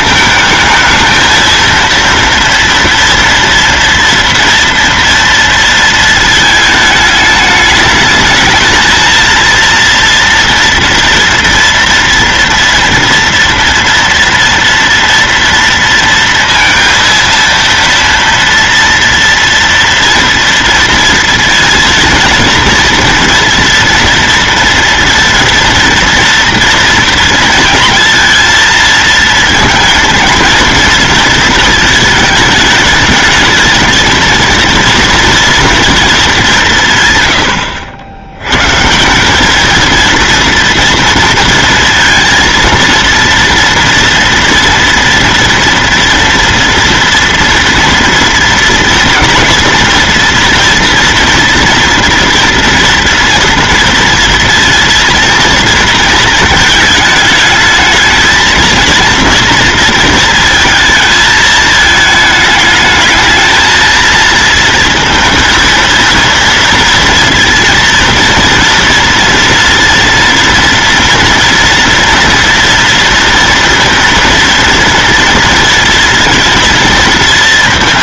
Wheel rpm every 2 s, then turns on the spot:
230, 230, 230, 220, 230, 230, 230, 230, 230, 230, 230, 230, 230, 230, 230, 230, 220, 230, 140, 160, 230, 230, 230, 230, 240, 230, 240, 230, 220, 230, 220, 210, 230, 230, 230, 230, 230, 230, 220.
none